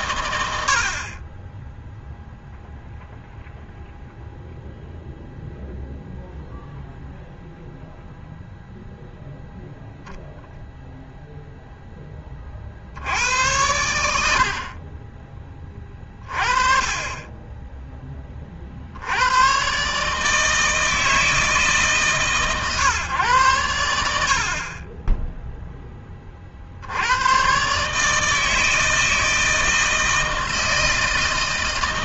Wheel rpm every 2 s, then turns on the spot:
90, 0, 0, 0, 0, 10, 50, 50, 30, 50, 160, 140, 40, 50, 160, 160.
none